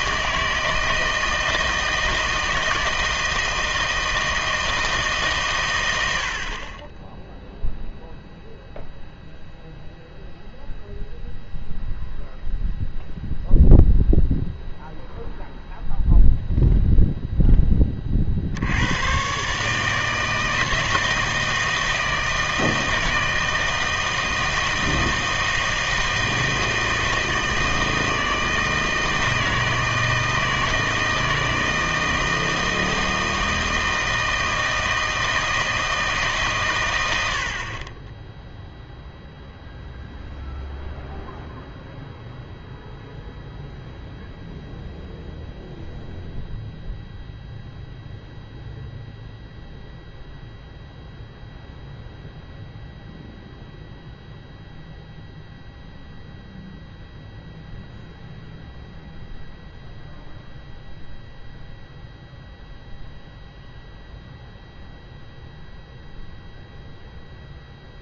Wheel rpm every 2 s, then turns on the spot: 160, 160, 160, 40, 0, 0, 0, 0, 0, 70, 160, 160, 160, 160, 160, 160, 160, 160, 120, 0, 0, 0, 0, 0, 0, 0, 0, 0, 0, 0, 0, 0, 0, 0.
none